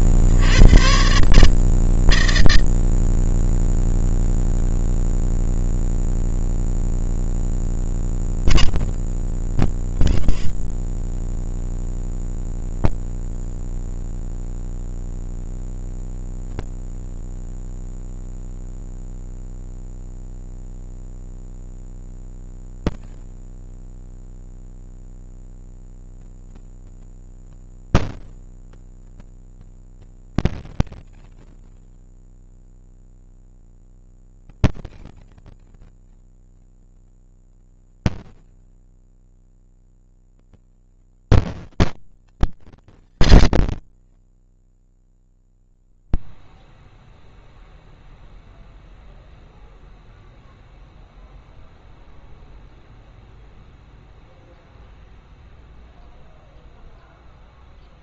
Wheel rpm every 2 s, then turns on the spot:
80, 160, 160, 160, 160, 70, 30, 70, 160, 160, 210, 230, 230, 230, 230, 230, 230, 230, 230, 240, 230, 140, 0, 0, 0, 0, 0, 0, 0.
10-14